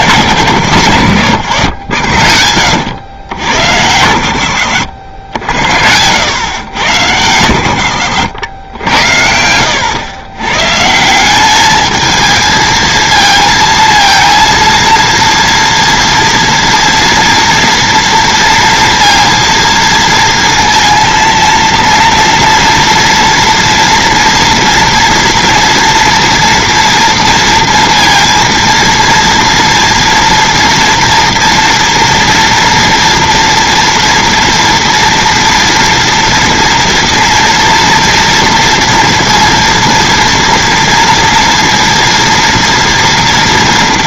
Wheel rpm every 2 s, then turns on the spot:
120, 80, 90, 110, 90, 140, 220, 230, 230, 230, 230, 240, 230, 230, 230, 230, 240, 230, 230, 230, 230, 230.
none